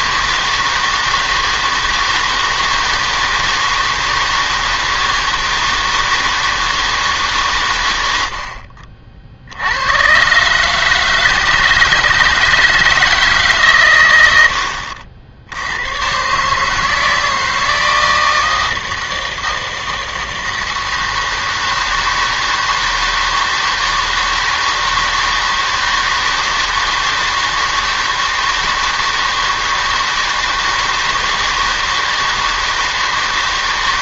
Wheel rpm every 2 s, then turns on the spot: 160, 160, 160, 160, 50, 150, 160, 70, 150, 160, 160, 160, 160, 160, 160, 160, 160.
none